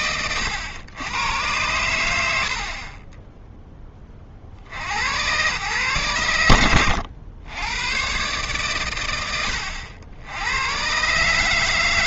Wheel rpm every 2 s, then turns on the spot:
110, 50, 80, 90, 120, 130.
none